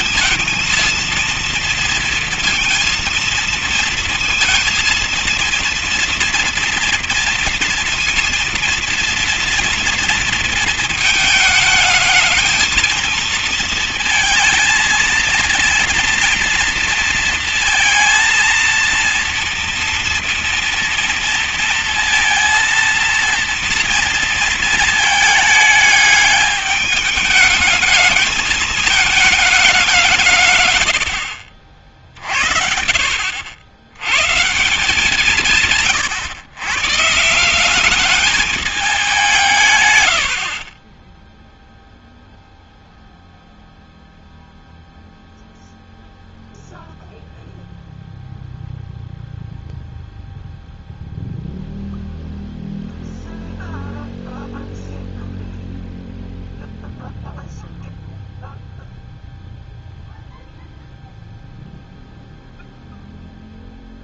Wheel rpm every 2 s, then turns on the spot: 220, 230, 230, 230, 230, 230, 220, 220, 230, 230, 230, 230, 230, 210, 220, 170, 40, 90, 130, 210, 120, 0, 0, 0, 0, 0, 0, 0, 0, 0, 0, 0.
40-42